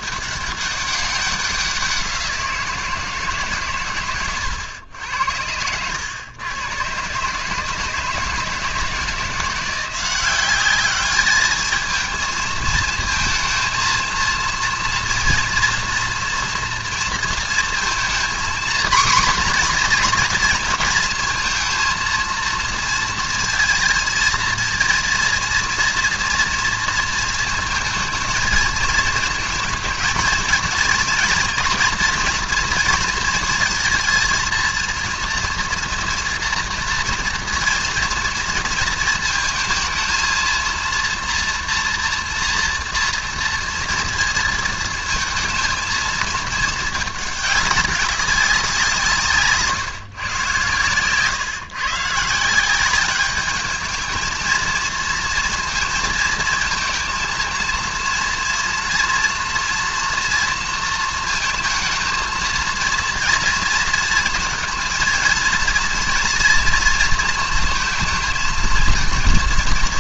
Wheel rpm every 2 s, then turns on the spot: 200, 170, 110, 110, 160, 200, 220, 230, 230, 240, 230, 230, 230, 230, 220, 230, 230, 230, 240, 230, 230, 230, 220, 220, 180, 120, 170, 220, 230, 230, 230, 230, 230, 230, 230.
none